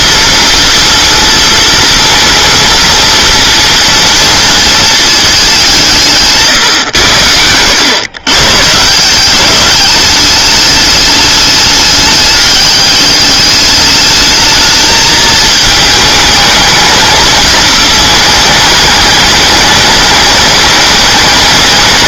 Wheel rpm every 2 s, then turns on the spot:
240, 230, 230, 120, 150, 210, 200, 220, 210, 220, 200.
none